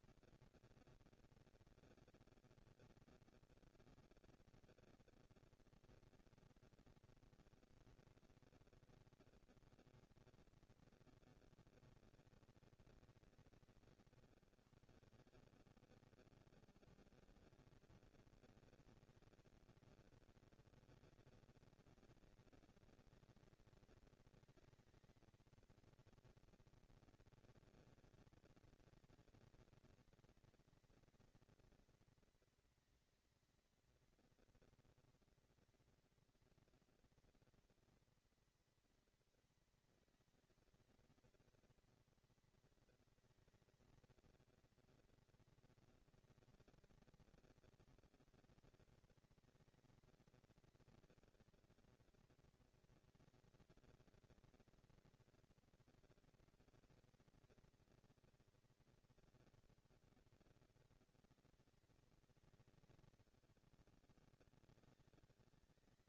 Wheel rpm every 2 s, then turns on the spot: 230, 230, 230, 220, 230, 230, 190, 140, 110, 220, 220, 220, 220, 230, 230, 220, 230, 240, 230, 230, 220, 230, 230, 230, 230, 230, 230, 230, 230, 220, 200, 190, 200.
none